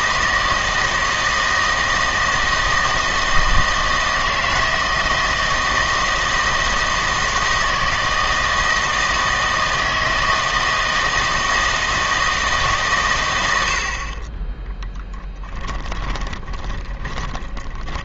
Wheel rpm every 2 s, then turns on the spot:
160, 160, 160, 160, 160, 160, 150, 10, 20.
16-18